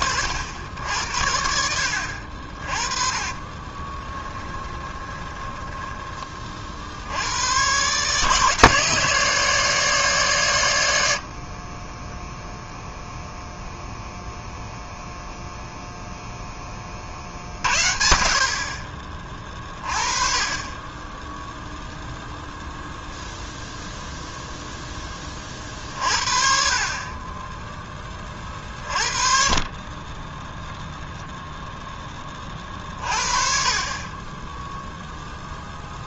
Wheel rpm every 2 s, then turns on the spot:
70, 30, 20, 40, 160, 110, 0, 0, 10, 40, 20, 0, 0, 40, 40, 0, 30, 0.
4-6